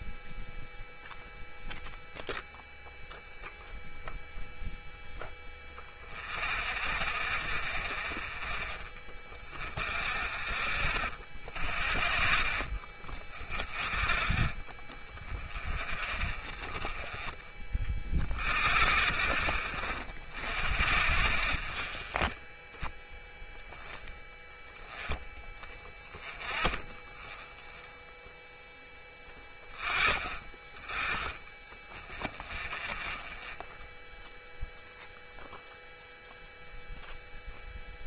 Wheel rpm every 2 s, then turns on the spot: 0, 0, 0, 0, 0, 0, 0, 0, 0, 0, 0, 0, 0, 0, 0, 0, 0, 0, 0.
none